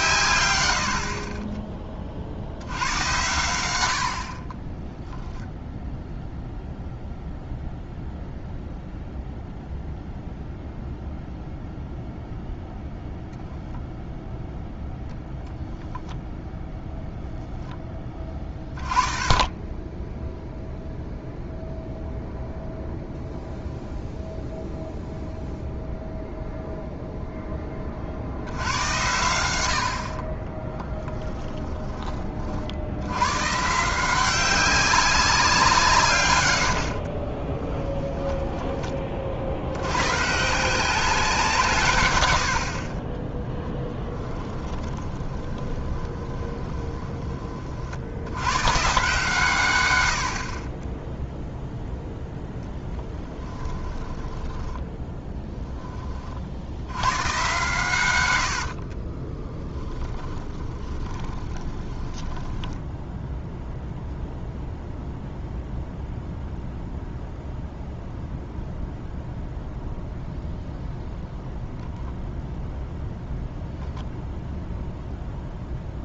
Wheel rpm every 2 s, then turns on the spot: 90, 90, 30, 0, 0, 0, 0, 0, 0, 20, 0, 0, 0, 0, 90, 10, 70, 190, 70, 20, 170, 60, 10, 20, 130, 20, 10, 10, 90, 50, 30, 10, 0, 0, 0, 0, 0, 0.
4-6 30-32 36-38 44-48 50-56 58-62